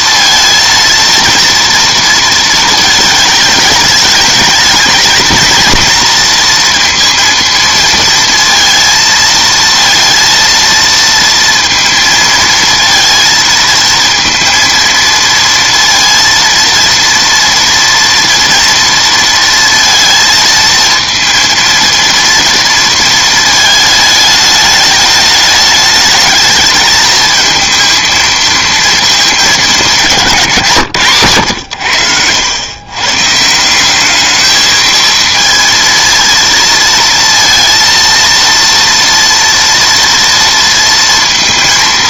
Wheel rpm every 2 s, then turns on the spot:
230, 220, 220, 230, 230, 230, 230, 230, 230, 230, 230, 230, 210, 220, 230, 130, 120, 220, 230, 230, 230.
none